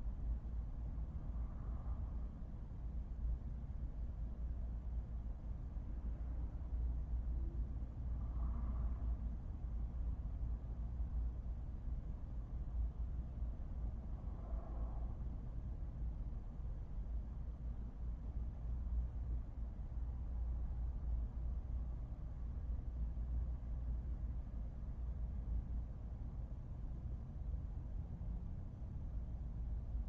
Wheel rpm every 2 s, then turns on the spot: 0, 0, 0, 0, 0, 0, 0, 0, 0, 0, 0, 0, 0, 0, 0.
none